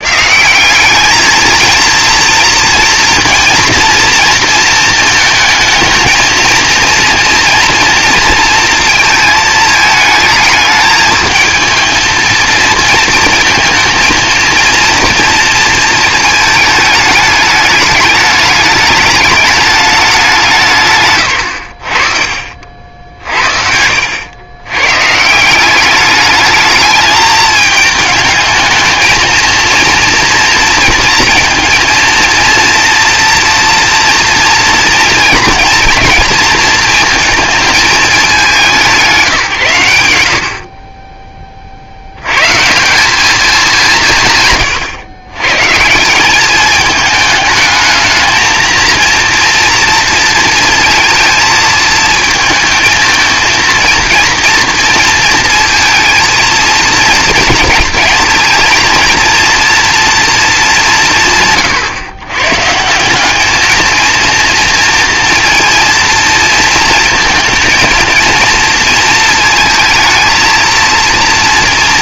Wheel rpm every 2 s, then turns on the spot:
200, 230, 230, 230, 230, 220, 230, 230, 210, 210, 150, 50, 120, 210, 220, 230, 230, 230, 230, 190, 50, 150, 130, 210, 230, 230, 220, 230, 230, 230, 200, 150, 230, 230, 230, 230.
none